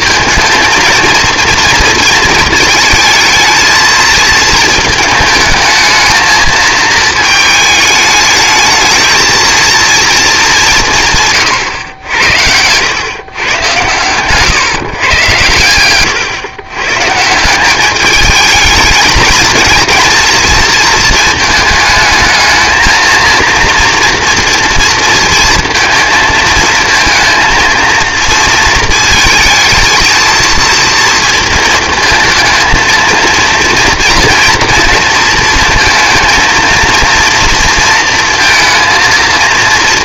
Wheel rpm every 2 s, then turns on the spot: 230, 230, 220, 220, 220, 190, 100, 140, 130, 220, 230, 220, 230, 230, 230, 230, 230, 230, 230, 230.
none